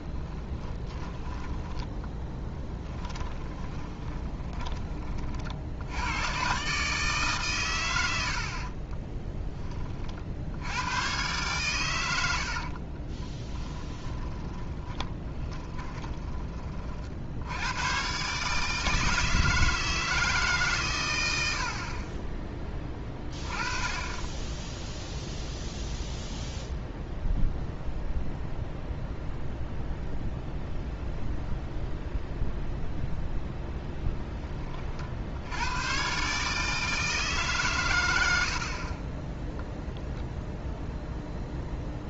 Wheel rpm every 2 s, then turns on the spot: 20, 10, 20, 130, 50, 90, 50, 20, 40, 150, 140, 20, 0, 0, 0, 0, 0, 40, 150, 50, 0.
0-4 8-10 12-16 38-40